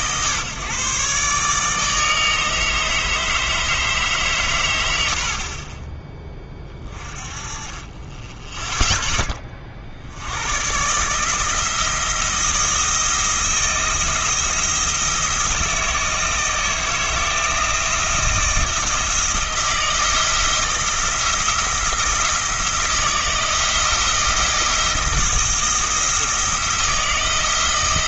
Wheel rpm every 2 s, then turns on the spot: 140, 160, 110, 20, 0, 120, 170, 170, 160, 160, 160, 170, 160, 160.
none